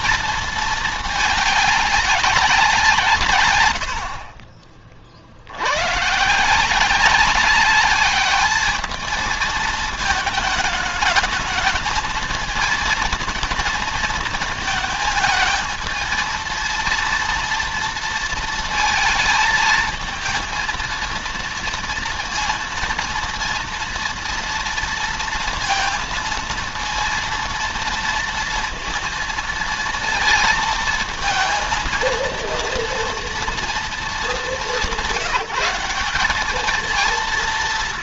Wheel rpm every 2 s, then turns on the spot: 220, 170, 40, 180, 210, 210, 220, 220, 230, 230, 230, 230, 230, 230, 230, 230, 230, 190, 210.
none